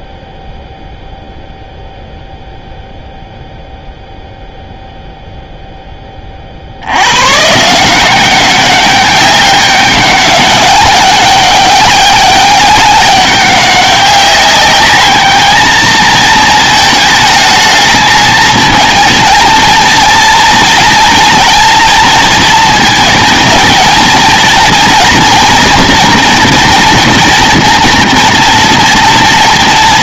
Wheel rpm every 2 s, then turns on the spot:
0, 0, 0, 70, 190, 200, 200, 200, 220, 230, 230, 220, 230, 230, 230.
none